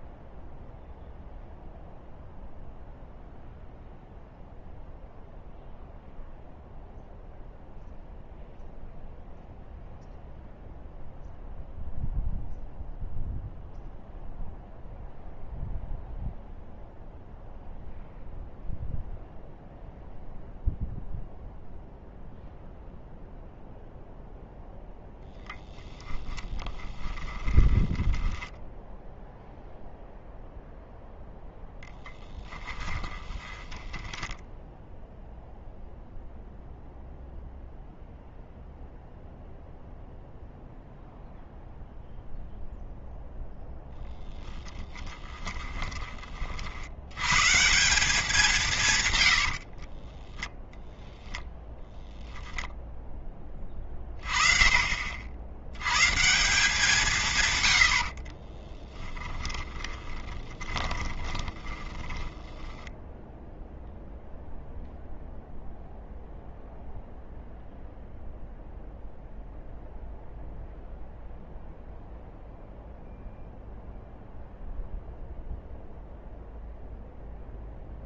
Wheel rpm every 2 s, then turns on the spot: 0, 0, 0, 0, 0, 0, 0, 0, 0, 0, 0, 0, 0, 20, 10, 0, 10, 10, 0, 0, 0, 0, 10, 50, 190, 10, 0, 30, 170, 20, 30, 10, 0, 0, 0, 0, 0, 0, 0.
26-28 32-36 58-64